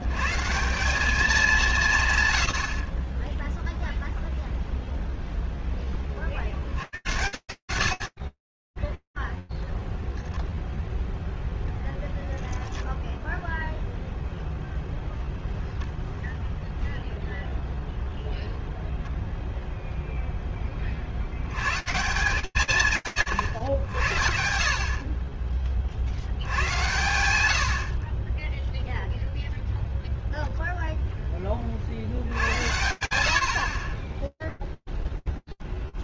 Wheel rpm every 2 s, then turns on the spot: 160, 60, 0, 150, 30, 0, 0, 10, 0, 0, 100, 130, 40, 90, 0, 50, 50, 10.
none